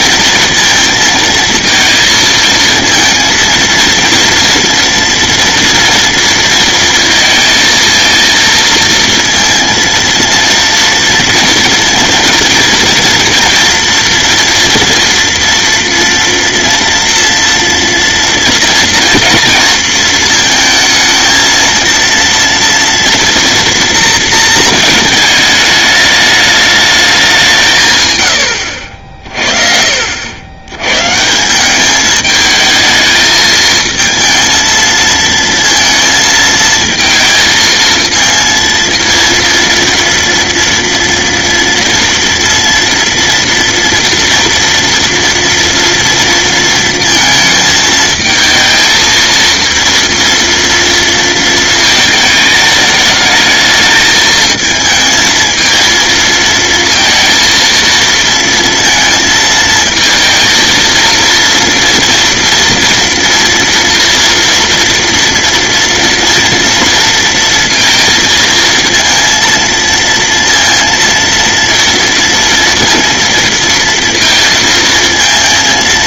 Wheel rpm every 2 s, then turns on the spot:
230, 230, 230, 230, 230, 230, 230, 230, 230, 240, 220, 230, 220, 210, 70, 120, 220, 230, 230, 230, 230, 230, 230, 230, 220, 230, 210, 220, 230, 230, 230, 230, 230, 230, 230, 230, 230, 230.
none